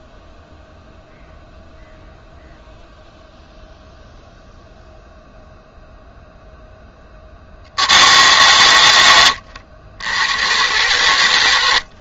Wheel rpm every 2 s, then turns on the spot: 0, 0, 0, 0, 100, 110.
none